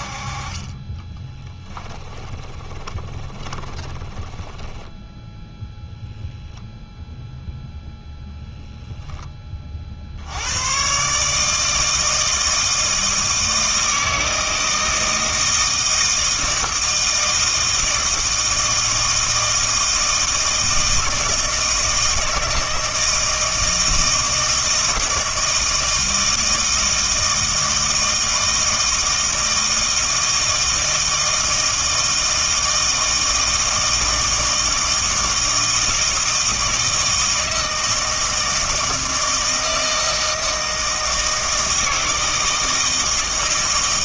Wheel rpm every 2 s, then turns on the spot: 20, 20, 10, 0, 0, 120, 160, 160, 160, 160, 160, 160, 160, 160, 160, 160, 160, 160, 160, 160, 160, 160.
2-6